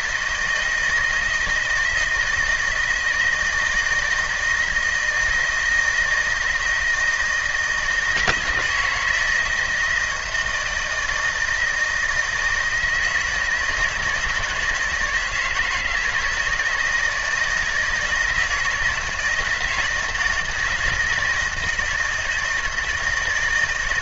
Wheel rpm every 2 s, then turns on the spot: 160, 160, 160, 160, 160, 160, 160, 160, 170, 160, 160, 160.
none